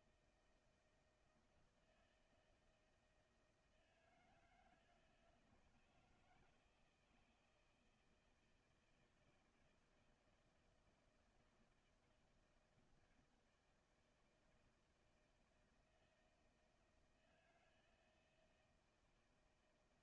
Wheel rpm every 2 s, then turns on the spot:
160, 160, 160, 160, 160, 170, 160, 160, 160, 160.
none